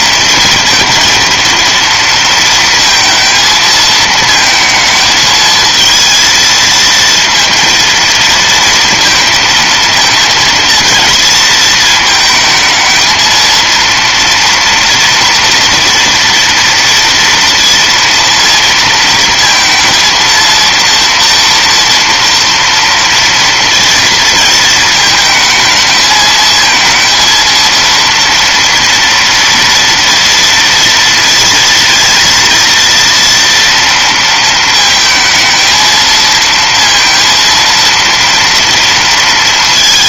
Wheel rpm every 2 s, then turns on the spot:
230, 220, 220, 230, 230, 220, 230, 230, 230, 230, 240, 230, 220, 230, 230, 230, 230, 220, 230, 220.
none